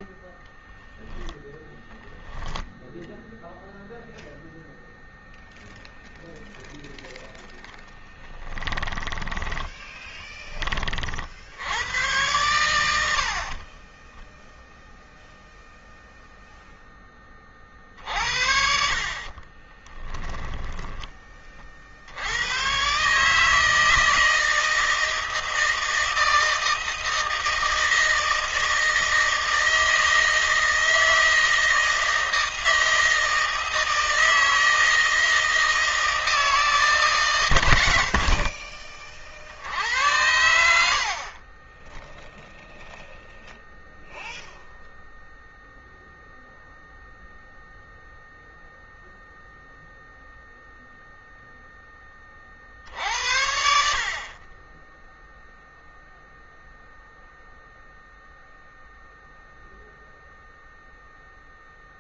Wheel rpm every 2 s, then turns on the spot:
0, 0, 0, 0, 10, 20, 100, 10, 0, 50, 10, 100, 160, 160, 160, 160, 160, 160, 160, 50, 100, 0, 0, 0, 0, 0, 40, 20, 0, 0, 0.
8-10 20-22 38-40